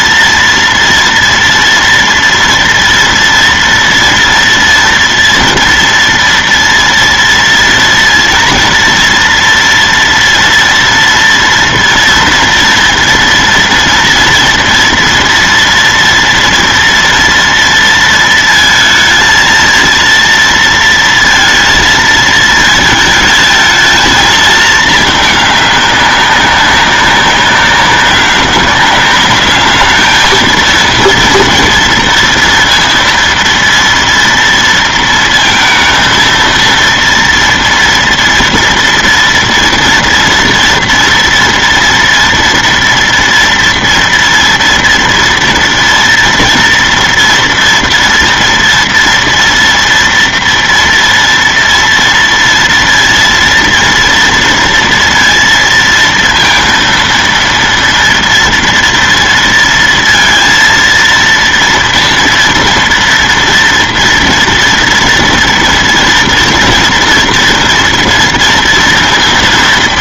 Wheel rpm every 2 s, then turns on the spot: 230, 230, 230, 230, 230, 230, 230, 230, 240, 230, 230, 220, 220, 200, 200, 220, 230, 230, 230, 230, 230, 230, 230, 240, 230, 230, 230, 230, 230, 230, 230, 240, 230, 230, 230.
none